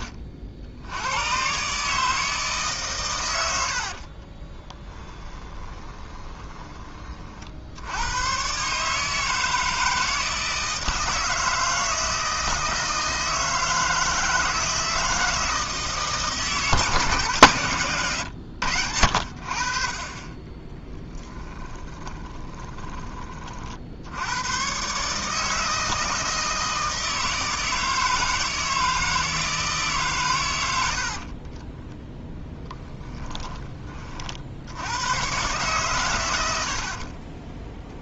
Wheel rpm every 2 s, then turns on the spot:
80, 130, 10, 20, 140, 160, 160, 160, 160, 80, 10, 20, 130, 160, 160, 80, 10, 100, 50.
4-6 20-22 32-34